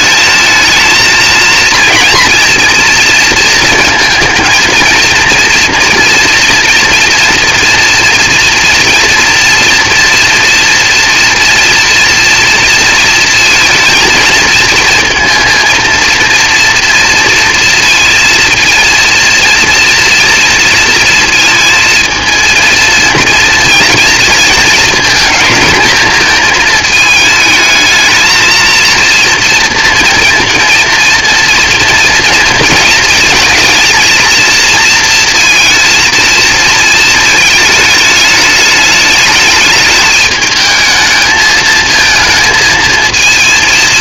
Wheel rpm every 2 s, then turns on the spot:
230, 230, 230, 240, 240, 230, 220, 230, 230, 230, 230, 230, 230, 220, 230, 230, 220, 220, 220, 210, 220, 230.
none